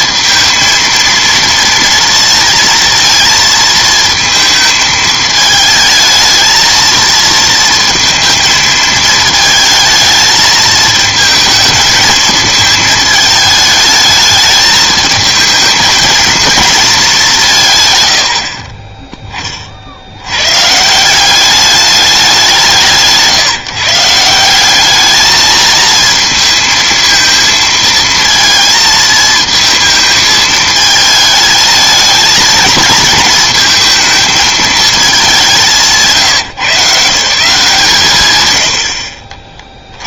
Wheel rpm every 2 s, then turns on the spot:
230, 230, 220, 220, 220, 220, 220, 220, 220, 20, 130, 180, 190, 220, 230, 220, 220, 220, 140, 80.
18-20